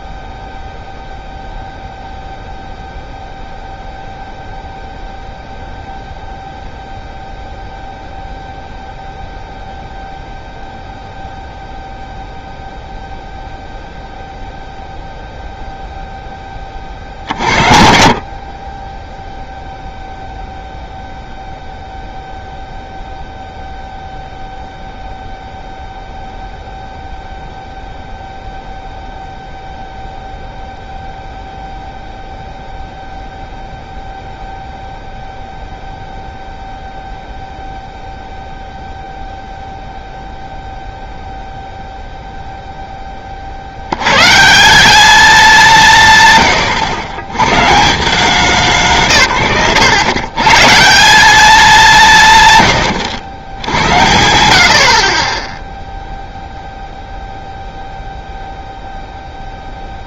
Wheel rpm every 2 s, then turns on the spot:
0, 0, 0, 0, 0, 0, 0, 0, 30, 40, 0, 0, 0, 0, 0, 0, 0, 0, 0, 0, 0, 0, 170, 120, 190, 150, 120, 70, 0, 0.
none